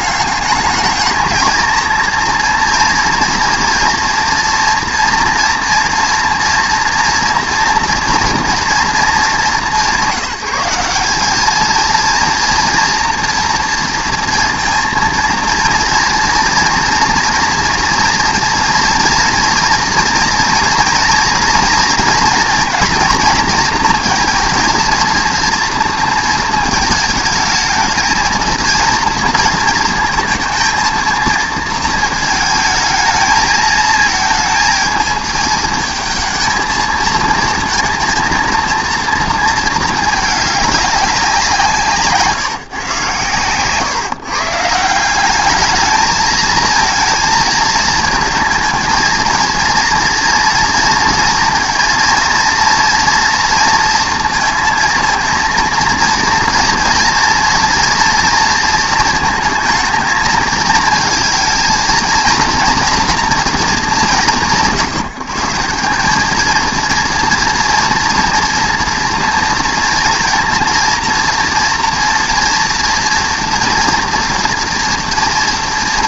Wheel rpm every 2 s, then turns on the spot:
210, 230, 230, 230, 230, 190, 230, 230, 230, 230, 230, 240, 230, 220, 220, 230, 220, 220, 220, 230, 210, 150, 150, 220, 230, 230, 230, 230, 230, 230, 220, 230, 160, 220, 230, 230, 230, 240.
none